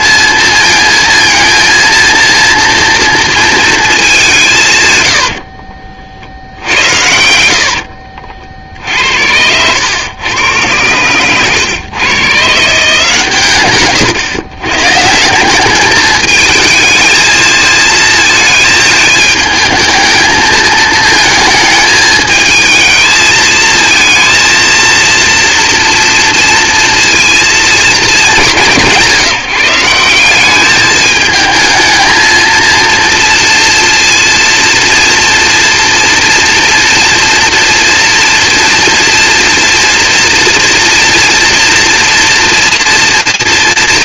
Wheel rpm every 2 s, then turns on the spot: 230, 230, 180, 70, 50, 130, 150, 120, 220, 220, 220, 220, 230, 230, 200, 190, 230, 230, 230, 240, 230, 230.
none